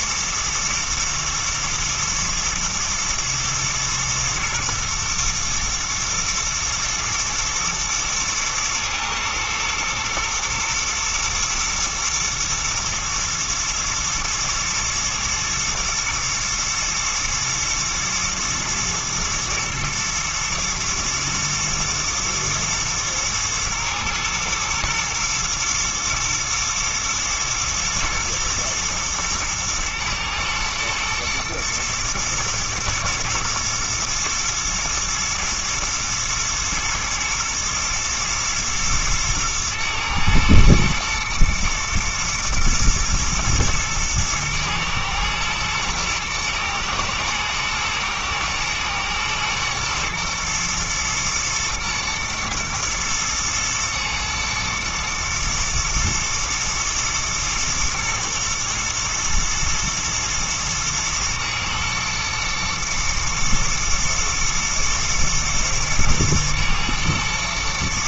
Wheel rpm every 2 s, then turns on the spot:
110, 120, 120, 110, 110, 110, 120, 120, 120, 120, 110, 120, 120, 110, 120, 110, 110, 110, 110, 110, 120, 120, 110, 120, 110, 120, 110, 110, 110, 120, 110, 110, 110, 120.
none